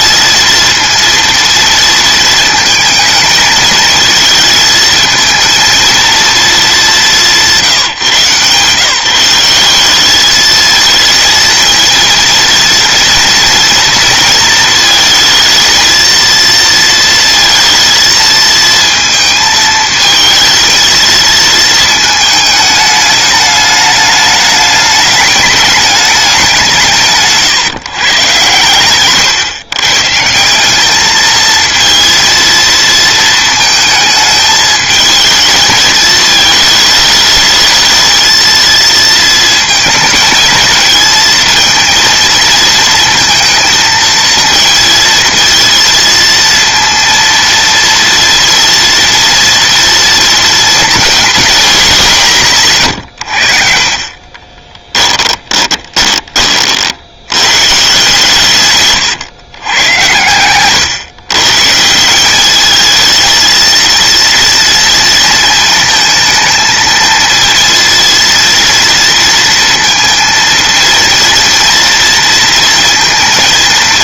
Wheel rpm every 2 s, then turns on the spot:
230, 220, 220, 200, 160, 220, 230, 220, 230, 230, 230, 210, 210, 160, 120, 210, 230, 220, 220, 230, 220, 220, 230, 230, 230, 230, 110, 10, 50, 120, 130, 220, 230, 230, 230, 230, 230.
28-30 54-56